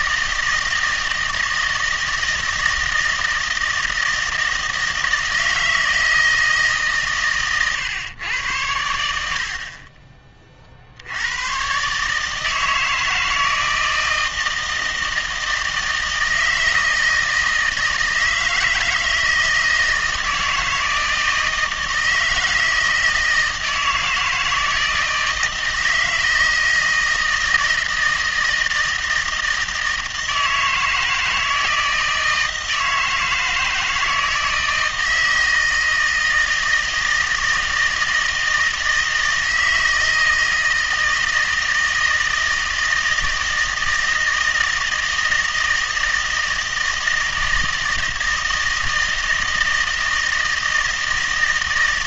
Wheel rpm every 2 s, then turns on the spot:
160, 160, 160, 150, 90, 50, 160, 160, 160, 160, 160, 160, 160, 160, 160, 160, 160, 160, 160, 160, 160, 160, 160, 160, 160, 160.
none